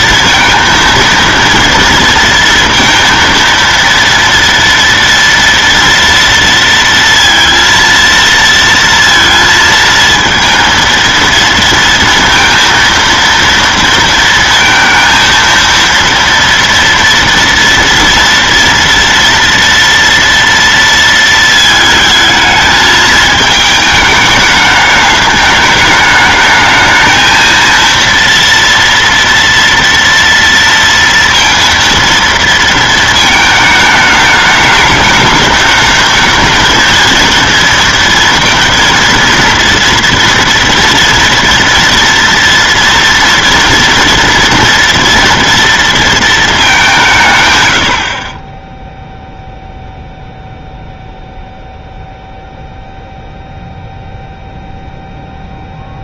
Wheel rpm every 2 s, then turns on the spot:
230, 230, 240, 230, 230, 230, 230, 230, 230, 230, 230, 220, 210, 220, 230, 230, 220, 210, 220, 230, 230, 230, 230, 200, 10, 0, 0, 0.
none